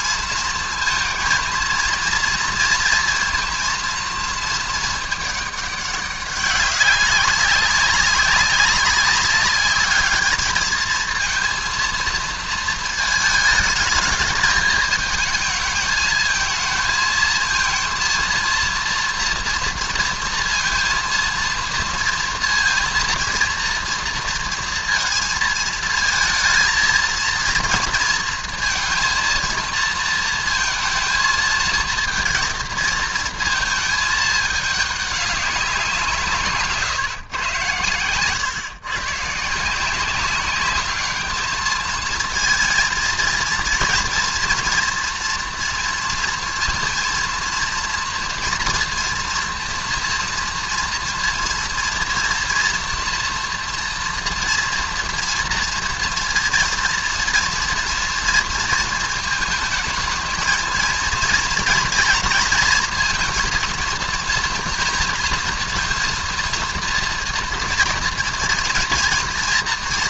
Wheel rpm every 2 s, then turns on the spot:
230, 230, 220, 190, 200, 220, 220, 220, 220, 230, 230, 230, 230, 230, 230, 230, 230, 200, 140, 130, 210, 230, 240, 230, 240, 230, 230, 230, 230, 220, 230, 230, 240, 240, 230.
none